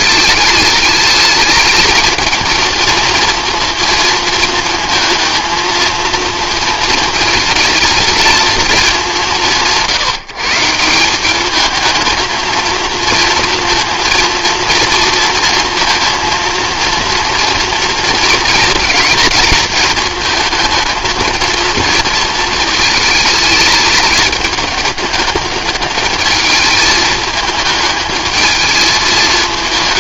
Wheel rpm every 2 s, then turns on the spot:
210, 220, 220, 220, 220, 160, 220, 230, 230, 220, 220, 220, 210, 220, 220.
none